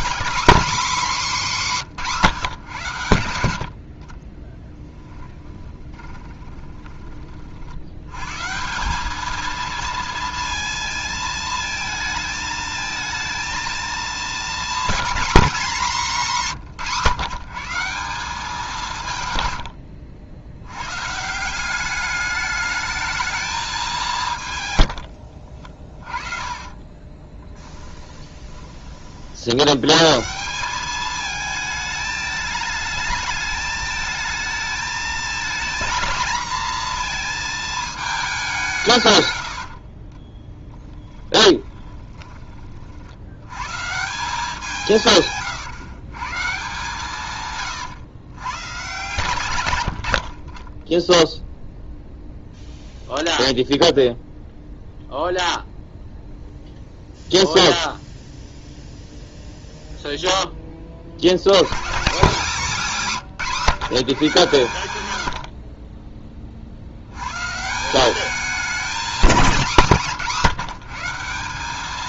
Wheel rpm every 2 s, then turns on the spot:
260, 140, 10, 20, 160, 230, 220, 240, 180, 180, 110, 210, 110, 30, 20, 190, 210, 220, 230, 170, 20, 40, 170, 140, 130, 20, 0, 0, 0, 0, 20, 200, 130, 40, 220, 190.
4-8 24-28 40-42